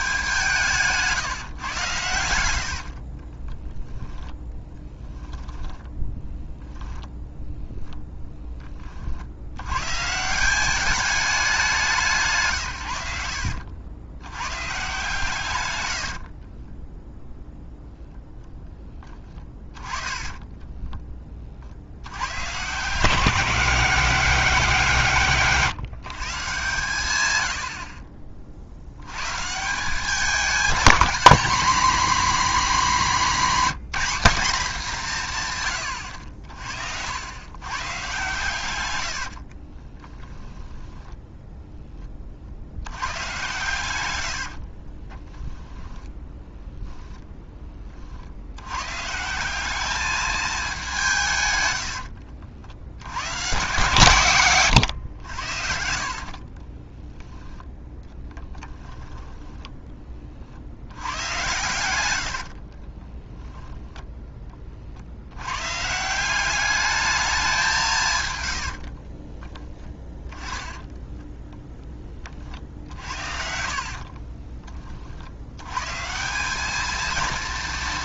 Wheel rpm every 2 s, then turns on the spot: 150, 50, 10, 10, 30, 200, 100, 140, 10, 10, 20, 170, 170, 110, 100, 220, 240, 190, 70, 100, 10, 90, 20, 0, 140, 190, 90, 110, 20, 10, 80, 30, 60, 210, 50, 10, 60, 40, 230.
0-4 38-42 44-46 56-60 62-64 68-70